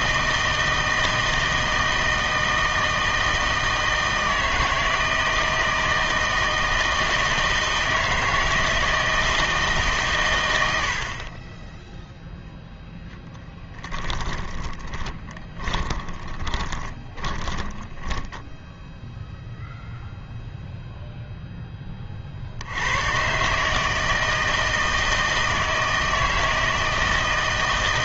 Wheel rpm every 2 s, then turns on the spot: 160, 160, 160, 160, 160, 90, 0, 10, 20, 10, 0, 70, 160, 160.
14-20